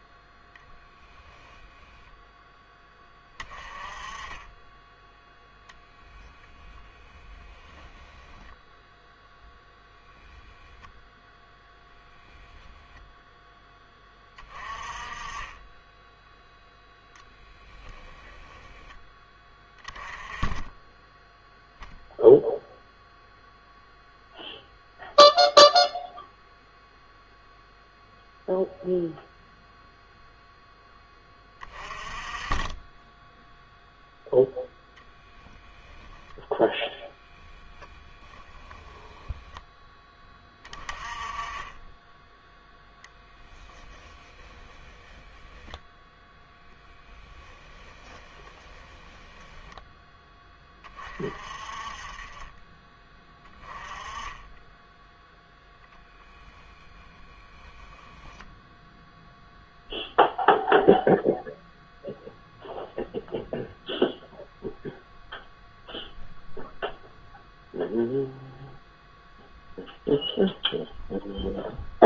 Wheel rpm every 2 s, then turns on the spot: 10, 10, 10, 0, 0, 0, 0, 20, 0, 10, 10, 0, 0, 0, 0, 10, 20, 0, 10, 10, 30, 0, 10, 0, 10, 20, 20, 10, 10, 0, 0, 0, 0, 0, 0, 0.
38-40 44-46 48-50 56-58